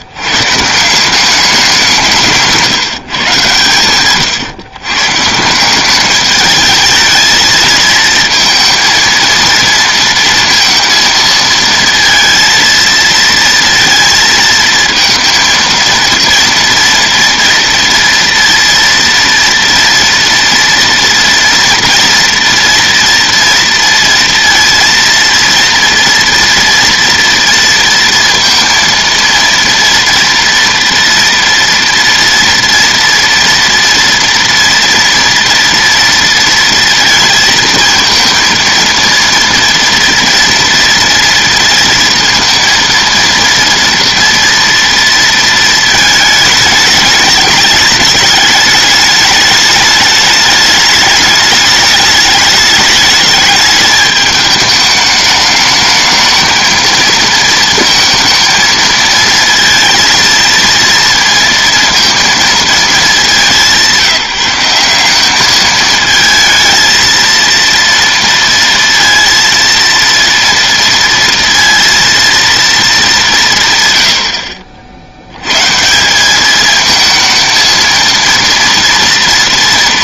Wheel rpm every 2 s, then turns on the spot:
180, 150, 140, 220, 230, 230, 230, 220, 230, 230, 230, 230, 230, 230, 230, 230, 230, 230, 230, 230, 230, 230, 230, 210, 210, 210, 210, 210, 220, 230, 230, 210, 190, 230, 230, 230, 210, 70, 220, 230.
none